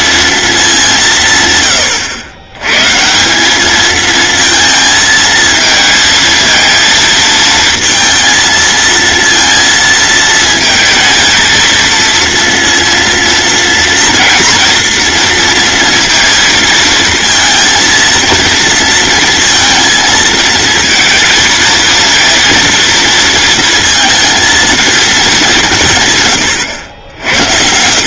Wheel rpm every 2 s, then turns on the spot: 190, 120, 220, 220, 230, 230, 230, 230, 230, 230, 230, 230, 230, 90.
none